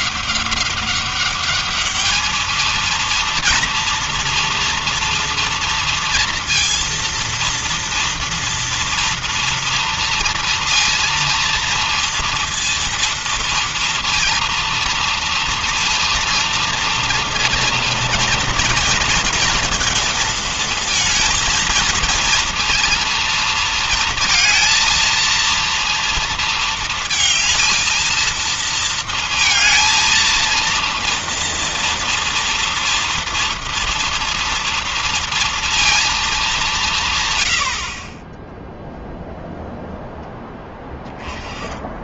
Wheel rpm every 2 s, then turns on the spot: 200, 230, 230, 230, 230, 230, 230, 230, 230, 230, 230, 230, 230, 220, 220, 230, 230, 230, 140, 0, 20.
none